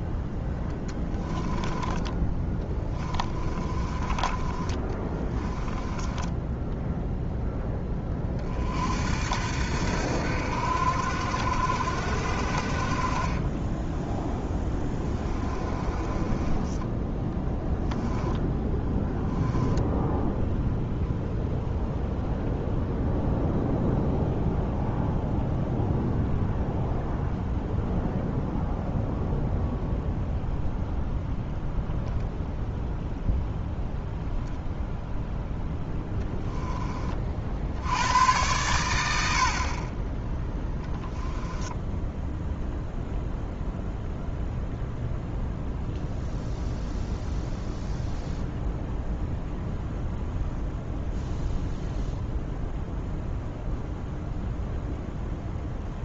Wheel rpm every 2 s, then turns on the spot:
10, 20, 20, 0, 50, 70, 50, 10, 10, 10, 0, 0, 0, 0, 0, 0, 0, 0, 20, 100, 10, 0, 0, 0, 0, 0, 0, 0.
0-4 14-16 18-20 40-42